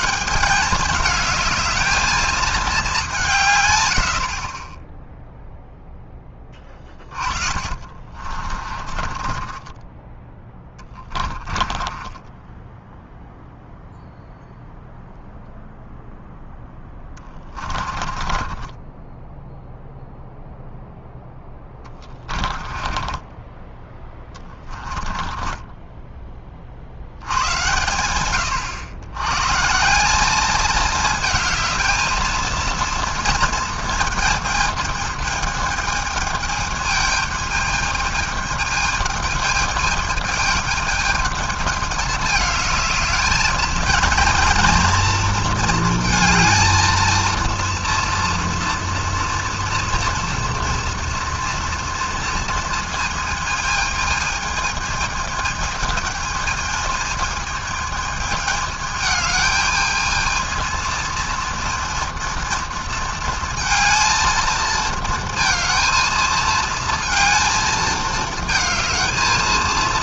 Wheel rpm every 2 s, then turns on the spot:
200, 220, 30, 20, 40, 10, 10, 0, 10, 20, 0, 20, 20, 40, 100, 210, 230, 220, 210, 210, 220, 220, 230, 220, 230, 230, 230, 220, 220, 220, 220, 230, 220, 230, 220.
6-10 12-14 16-20 22-26